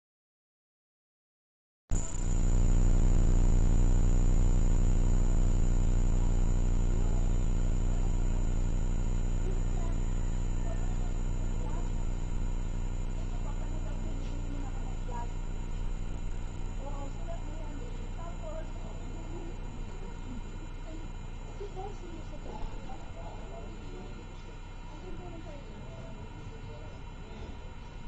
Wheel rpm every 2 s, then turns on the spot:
0, 0, 0, 0, 0, 0, 0, 0, 0, 0, 0, 0, 0, 0.
none